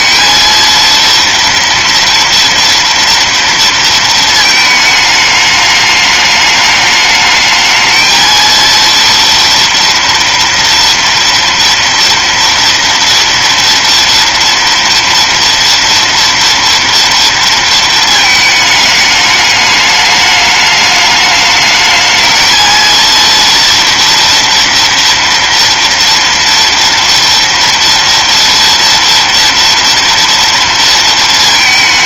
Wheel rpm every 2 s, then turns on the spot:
230, 230, 220, 210, 230, 230, 230, 230, 230, 210, 210, 230, 240, 230, 230, 230.
none